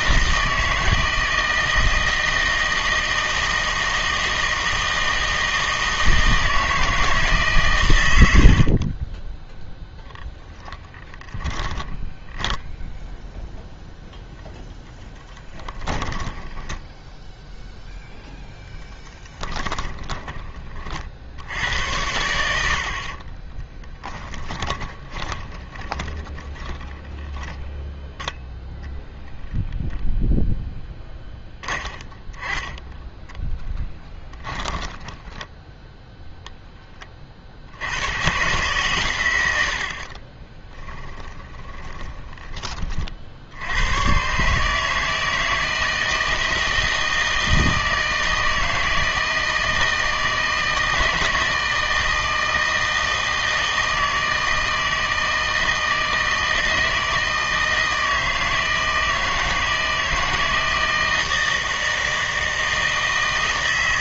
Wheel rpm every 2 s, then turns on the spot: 160, 160, 160, 160, 40, 10, 10, 0, 10, 10, 40, 80, 20, 10, 0, 10, 10, 10, 10, 120, 20, 30, 150, 160, 160, 160, 160, 160, 160, 160, 160, 160.
8-10 12-14 16-20 24-28 34-36 40-42